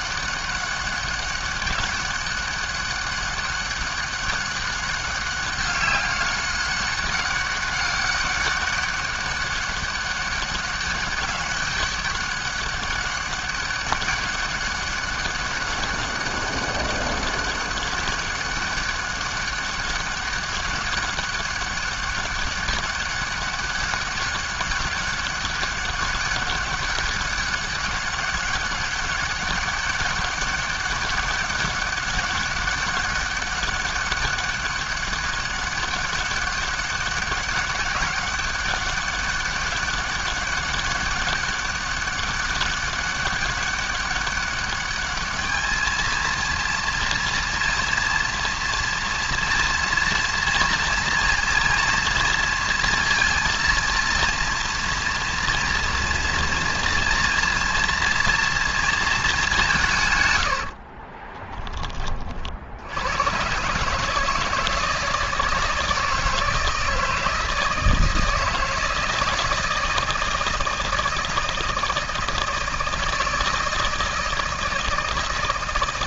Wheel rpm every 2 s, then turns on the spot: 200, 200, 200, 200, 200, 200, 200, 200, 200, 200, 200, 200, 200, 200, 200, 200, 200, 200, 200, 200, 200, 200, 200, 230, 230, 230, 230, 230, 230, 230, 60, 80, 160, 160, 160, 160, 160, 160.
60-62